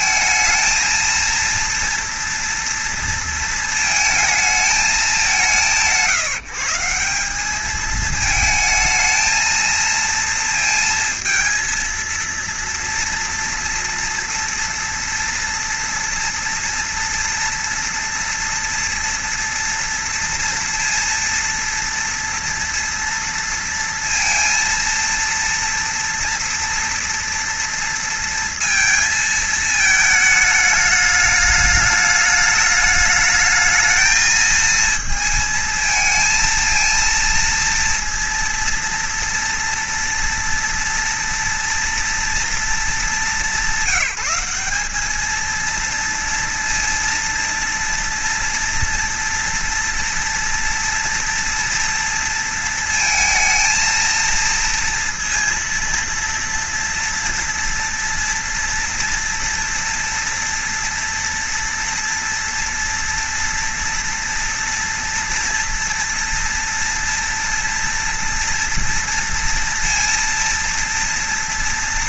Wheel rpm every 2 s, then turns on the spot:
230, 230, 200, 180, 220, 230, 230, 230, 230, 240, 230, 230, 230, 230, 230, 210, 210, 220, 230, 240, 240, 220, 210, 230, 240, 230, 220, 230, 230, 230, 230, 230, 240, 230, 230, 230.
none